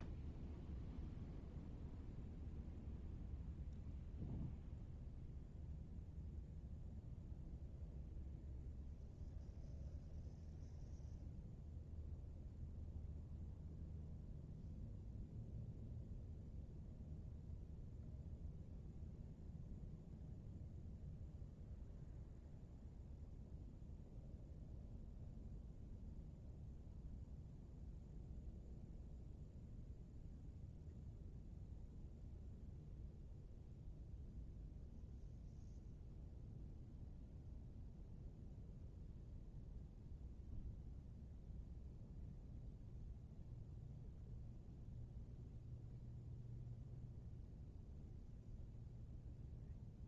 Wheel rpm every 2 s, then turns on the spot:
0, 0, 0, 0, 0, 0, 0, 0, 0, 0, 0, 0, 0, 0, 0, 0, 0, 0, 0, 0, 0, 0, 0, 0, 0.
none